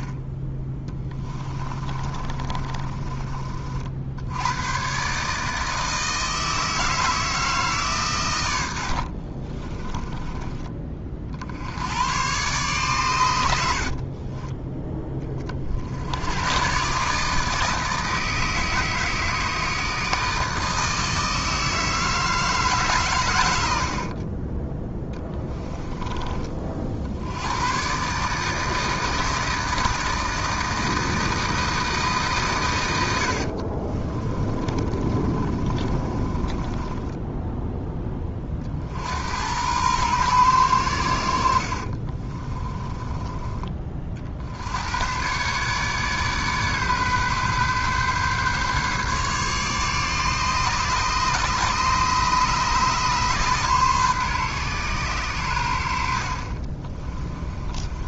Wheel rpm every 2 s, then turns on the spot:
20, 30, 120, 160, 90, 20, 120, 10, 130, 160, 160, 150, 10, 50, 160, 160, 110, 30, 20, 50, 100, 20, 80, 140, 140, 150, 140, 130, 30.
2-4 8-10 34-38 42-44 56-58